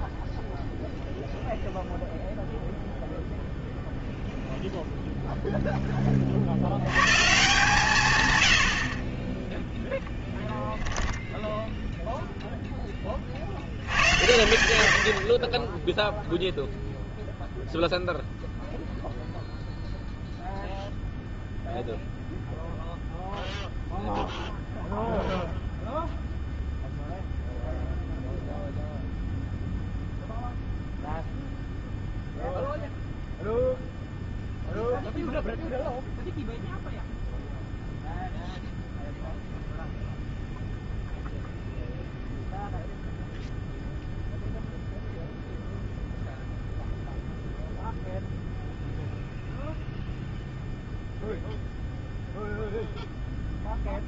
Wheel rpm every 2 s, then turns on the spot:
0, 0, 0, 110, 80, 0, 10, 90, 0, 0, 0, 0, 0, 0, 0, 0, 0, 0, 0, 0, 0, 0, 0, 0, 0, 0, 0.
none